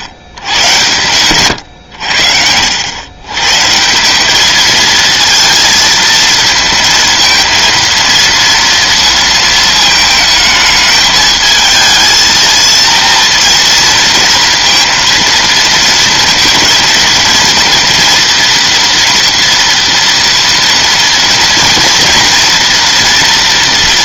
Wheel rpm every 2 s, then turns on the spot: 100, 90, 220, 230, 230, 220, 230, 230, 230, 230, 230, 230.
none